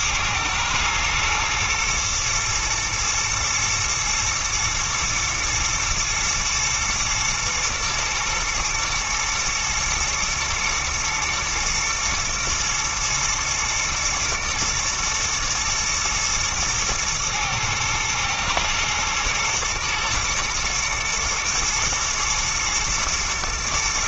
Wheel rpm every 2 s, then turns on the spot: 120, 120, 110, 120, 120, 110, 120, 110, 110, 110, 120, 110.
none